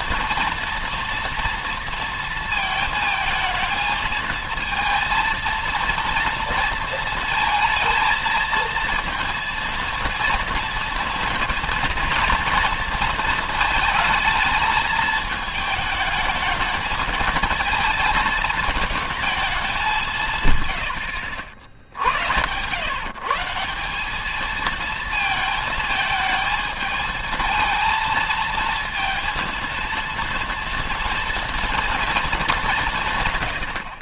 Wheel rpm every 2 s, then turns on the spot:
230, 220, 220, 230, 230, 230, 230, 220, 220, 220, 130, 100, 220, 220, 230, 230, 190.
none